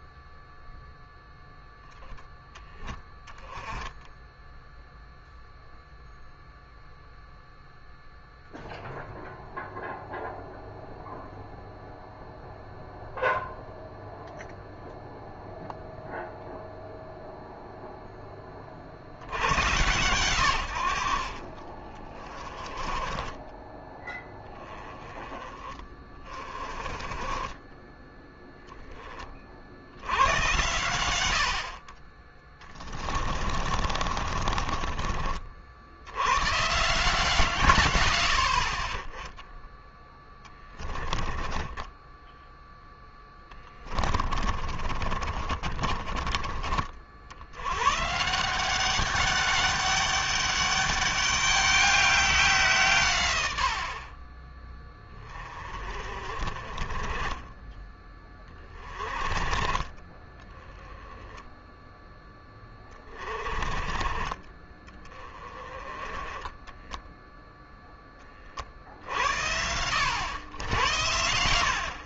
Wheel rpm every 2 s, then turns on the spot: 0, 10, 0, 0, 0, 0, 0, 0, 0, 50, 70, 20, 10, 30, 20, 90, 20, 40, 130, 30, 20, 10, 40, 50, 180, 200, 170, 20, 30, 30, 10, 20, 20, 10, 60, 90.
32-36 40-42 44-46 66-68